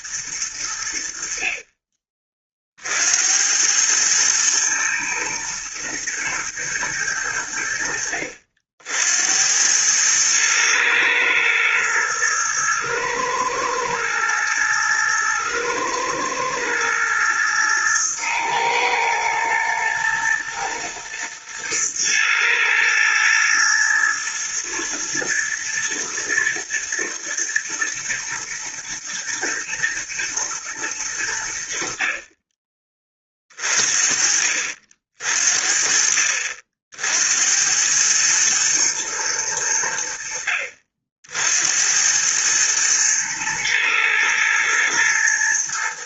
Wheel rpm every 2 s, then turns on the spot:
80, 50, 110, 110, 70, 110, 110, 110, 110, 110, 110, 110, 120, 120, 110, 110, 30, 50, 60, 110, 50, 110, 110.
none